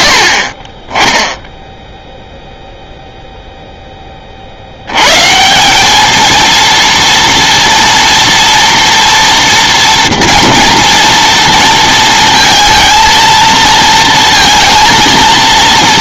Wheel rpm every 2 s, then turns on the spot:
40, 0, 90, 230, 230, 230, 230, 230.
none